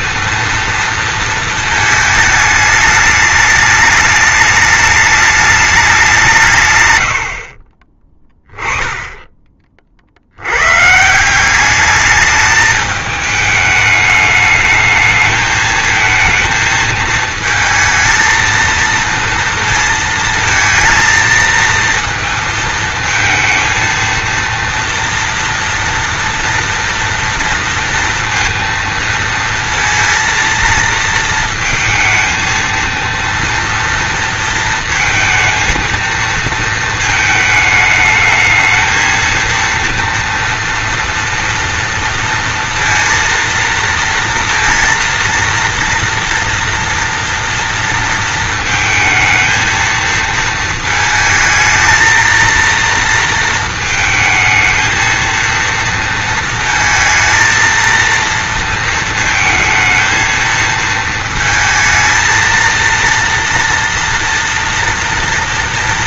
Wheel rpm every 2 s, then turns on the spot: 230, 210, 210, 130, 10, 120, 210, 220, 230, 230, 230, 220, 230, 230, 230, 230, 230, 230, 230, 220, 230, 230, 230, 230, 230, 220, 230, 220, 220, 230, 220, 230, 230.
none